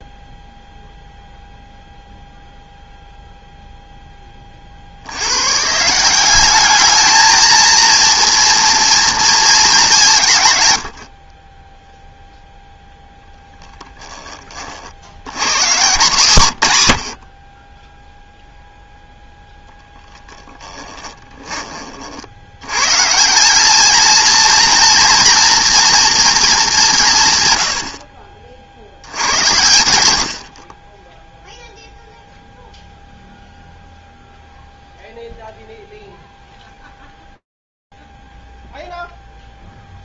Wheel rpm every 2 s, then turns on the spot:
0, 0, 40, 200, 230, 110, 0, 40, 120, 0, 10, 100, 230, 210, 50, 40, 0, 0, 0, 0.
20-22